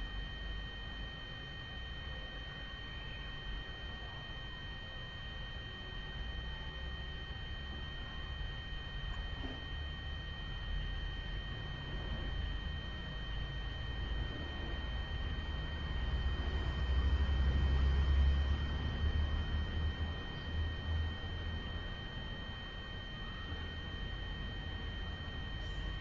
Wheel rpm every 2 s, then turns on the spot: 0, 0, 0, 0, 0, 0, 0, 0, 0, 0, 0, 0, 0.
none